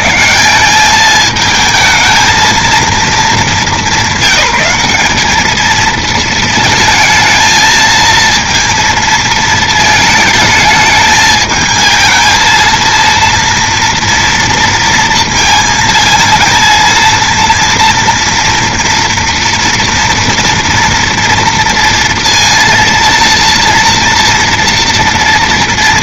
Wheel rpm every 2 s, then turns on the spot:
120, 220, 180, 230, 230, 220, 220, 230, 220, 230, 230, 230, 240.
none